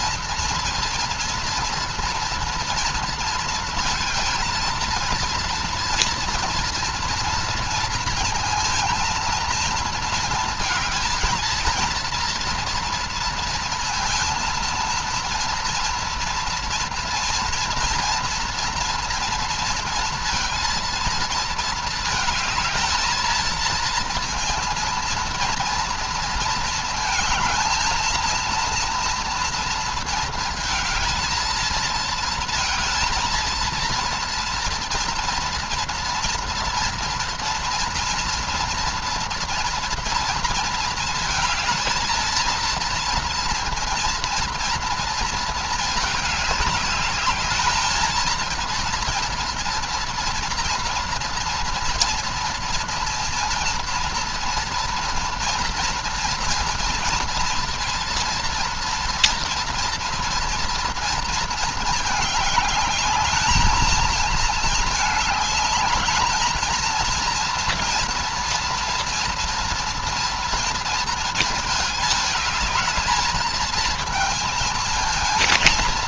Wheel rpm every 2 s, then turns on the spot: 230, 230, 230, 230, 230, 220, 230, 230, 230, 230, 230, 230, 230, 220, 230, 220, 230, 230, 230, 230, 220, 230, 230, 210, 230, 230, 230, 230, 230, 230, 230, 210, 220, 220, 230, 230, 220, 230.
none